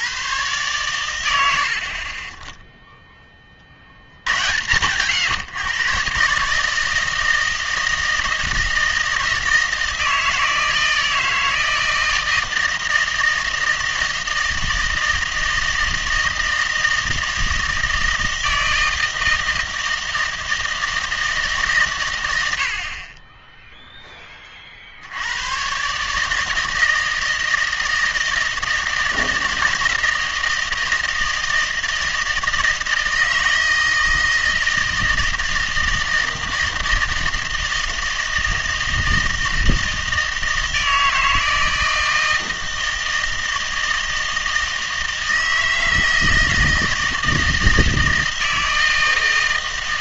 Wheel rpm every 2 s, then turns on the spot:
110, 10, 100, 150, 160, 160, 160, 160, 160, 160, 160, 70, 40, 160, 160, 160, 160, 160, 160, 160, 160, 160, 160, 160, 160.
none